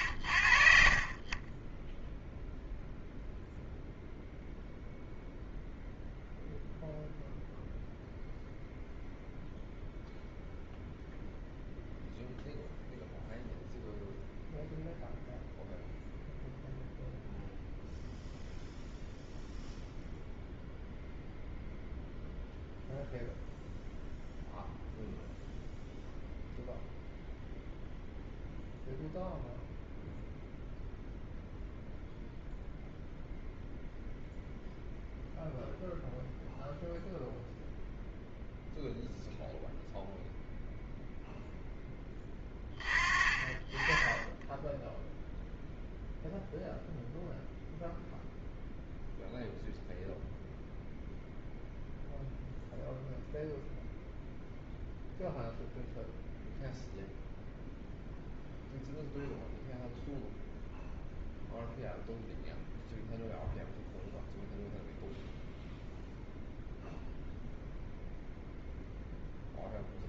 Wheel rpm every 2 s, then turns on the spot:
20, 0, 0, 0, 0, 0, 0, 0, 0, 0, 0, 0, 0, 0, 0, 0, 0, 0, 0, 0, 0, 30, 0, 0, 0, 0, 0, 0, 0, 0, 0, 0, 0, 0, 0.
none